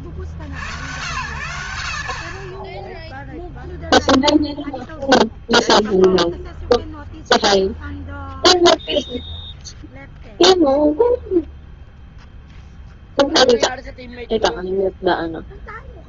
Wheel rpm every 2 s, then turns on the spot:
60, 50, 0, 0, 0, 0, 0, 0.
none